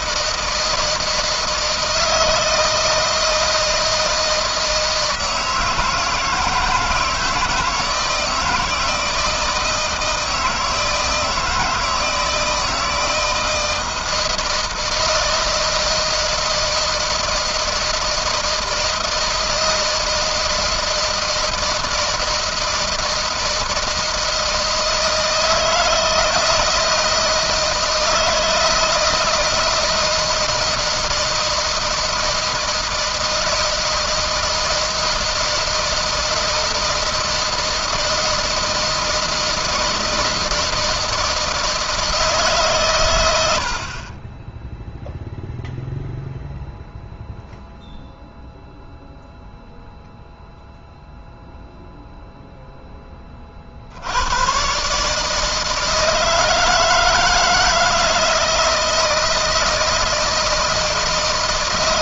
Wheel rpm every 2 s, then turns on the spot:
160, 160, 160, 160, 160, 160, 160, 160, 160, 160, 160, 160, 160, 160, 160, 160, 160, 160, 160, 160, 160, 130, 0, 0, 0, 0, 10, 140, 160, 160, 160.
none